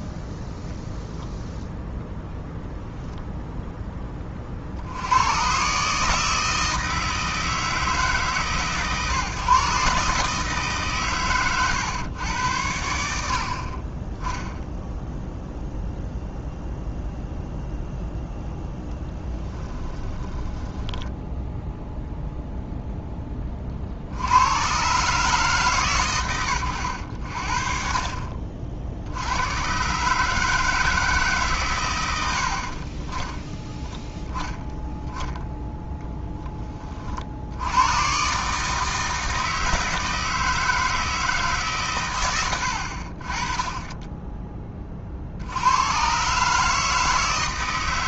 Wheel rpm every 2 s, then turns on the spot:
0, 10, 70, 160, 140, 140, 70, 0, 0, 10, 10, 0, 130, 90, 70, 160, 30, 10, 40, 160, 160, 60, 30, 160.
20-22